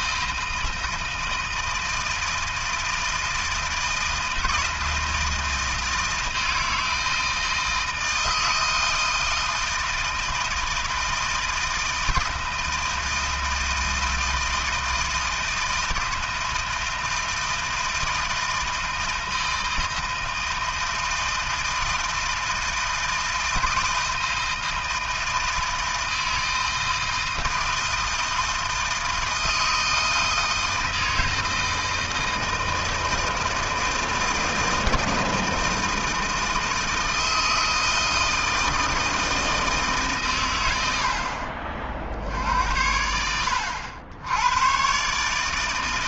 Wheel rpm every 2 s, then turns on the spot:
160, 160, 160, 160, 160, 160, 160, 160, 160, 160, 160, 160, 160, 160, 160, 160, 160, 160, 160, 160, 110, 70, 110.
none